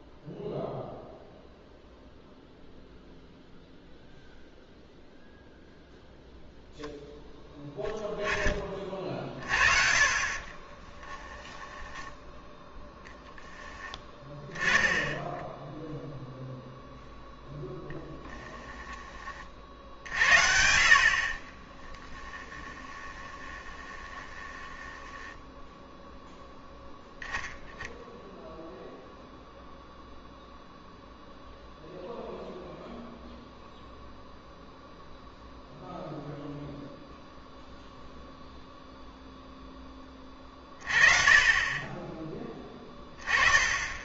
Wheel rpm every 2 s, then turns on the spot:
0, 0, 0, 0, 30, 30, 0, 10, 0, 20, 60, 20, 10, 0, 0, 0, 0, 0, 0, 0, 30, 20.
10-12 22-26